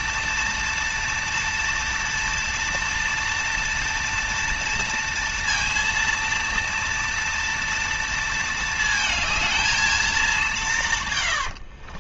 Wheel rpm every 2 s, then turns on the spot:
230, 230, 230, 230, 220, 170.
none